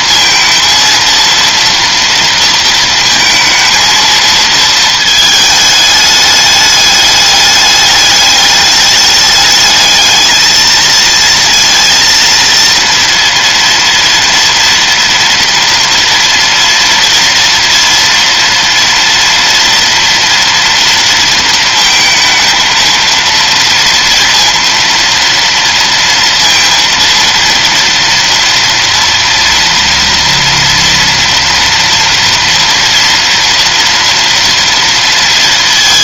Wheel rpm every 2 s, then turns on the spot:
230, 230, 220, 210, 210, 220, 230, 230, 230, 230, 230, 230, 230, 230, 230, 230, 230, 230.
none